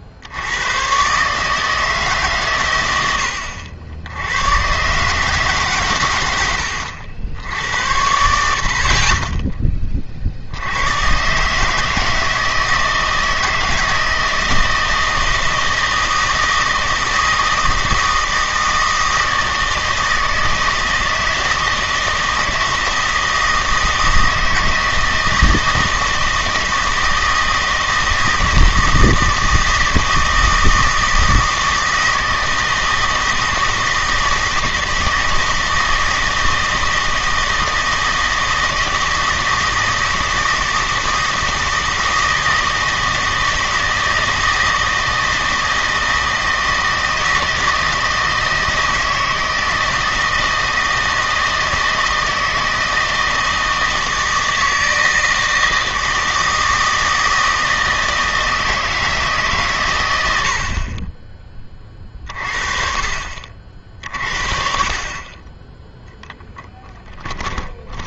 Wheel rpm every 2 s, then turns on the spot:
110, 110, 120, 100, 60, 80, 160, 160, 160, 160, 160, 160, 160, 160, 160, 160, 160, 160, 160, 160, 160, 160, 160, 160, 160, 160, 160, 160, 160, 160, 50, 40, 40, 10.
66-68